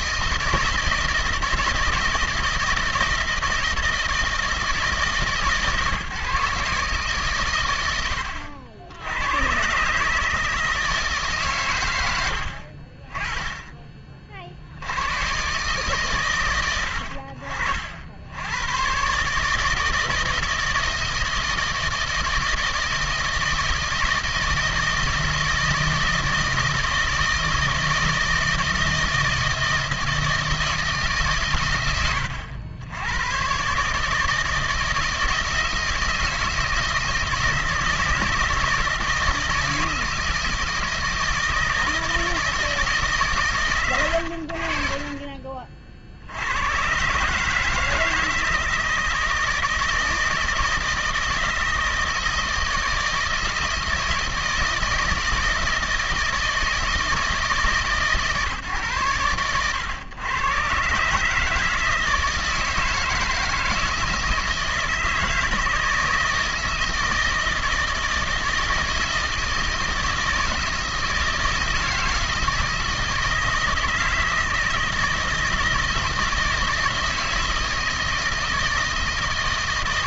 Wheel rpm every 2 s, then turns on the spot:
160, 160, 160, 140, 80, 150, 70, 60, 100, 90, 160, 160, 160, 160, 160, 160, 90, 160, 160, 160, 160, 160, 70, 90, 160, 160, 160, 160, 160, 130, 120, 160, 160, 160, 160, 160, 160, 160, 160, 160.
12-14